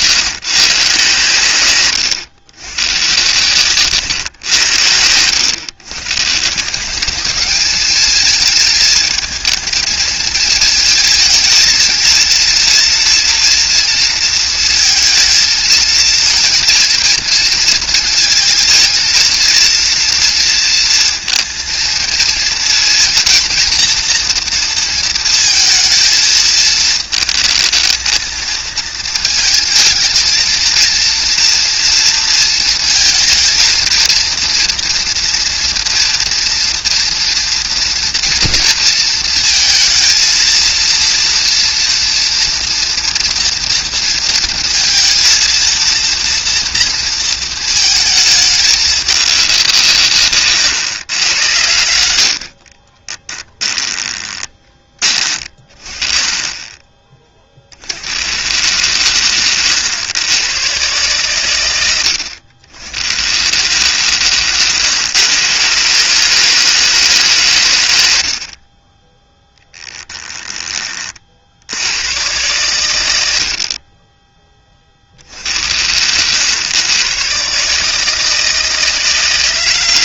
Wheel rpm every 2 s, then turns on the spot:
140, 120, 100, 180, 220, 220, 230, 230, 230, 230, 230, 230, 230, 220, 230, 230, 230, 230, 230, 230, 230, 230, 230, 230, 210, 120, 30, 20, 20, 130, 120, 90, 120, 160, 30, 20, 110, 30, 110, 160.
none